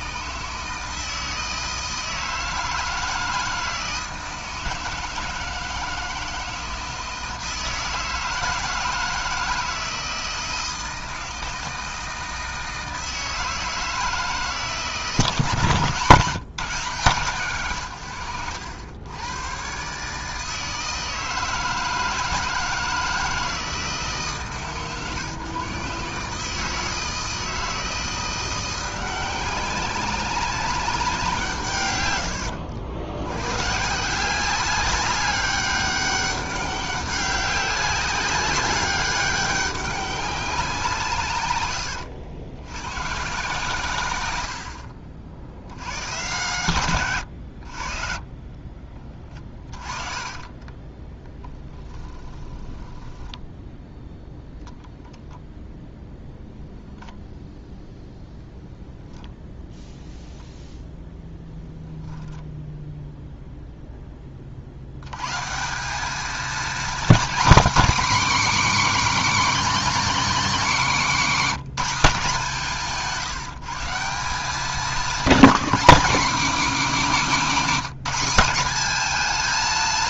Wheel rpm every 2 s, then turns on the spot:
160, 160, 160, 160, 160, 160, 160, 150, 170, 90, 160, 160, 130, 160, 180, 190, 80, 190, 190, 200, 170, 110, 60, 110, 20, 10, 10, 0, 0, 0, 0, 0, 70, 250, 290, 230, 170, 210, 230, 210.
48-54